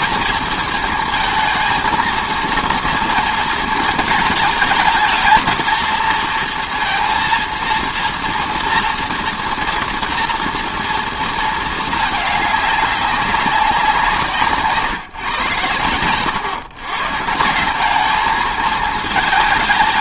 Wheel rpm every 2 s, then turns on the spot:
230, 230, 220, 230, 230, 230, 200, 150, 130, 220.
none